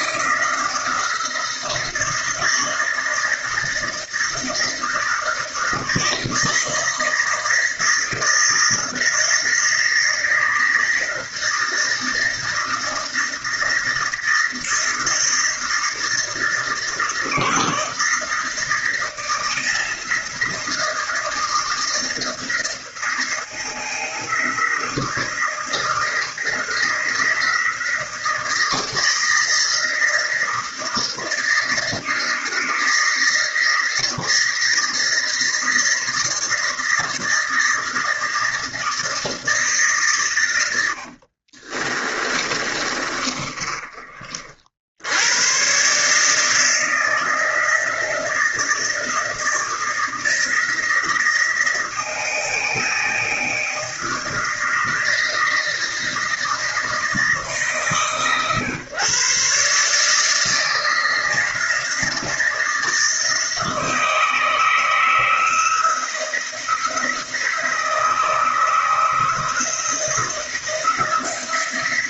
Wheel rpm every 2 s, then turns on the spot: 160, 160, 160, 160, 160, 160, 160, 160, 160, 160, 160, 160, 160, 170, 160, 160, 160, 160, 160, 160, 80, 30, 80, 160, 160, 160, 160, 160, 160, 130, 160, 160, 160, 160, 160, 170.
40-44